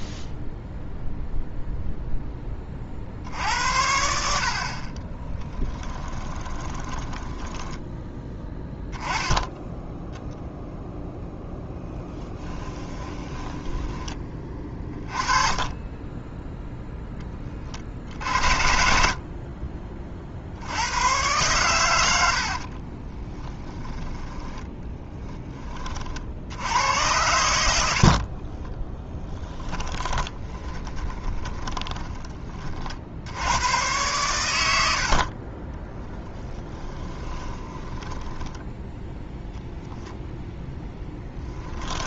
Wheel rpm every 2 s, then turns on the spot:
0, 30, 50, 20, 10, 0, 20, 20, 10, 60, 90, 40, 10, 80, 10, 20, 40, 90, 10, 10, 0.
6-8 12-14 22-26 28-32 36-38